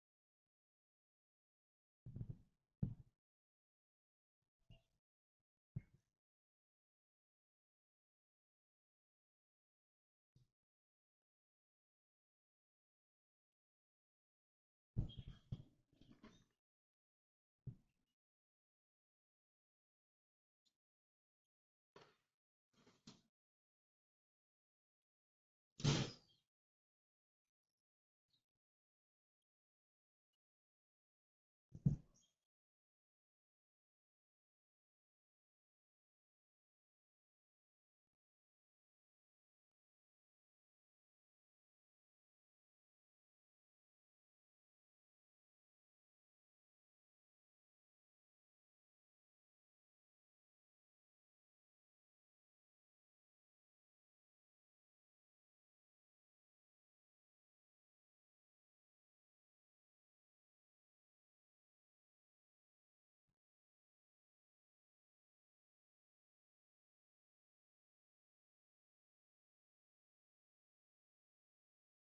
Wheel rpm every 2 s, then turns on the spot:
0, 0, 0, 0, 0, 0, 0, 0, 0, 0, 0, 0, 0, 0, 0, 0, 0, 0, 0, 0, 0, 0, 0, 0, 0, 0, 0, 0, 0, 0, 0, 0, 0, 0, 0, 0.
none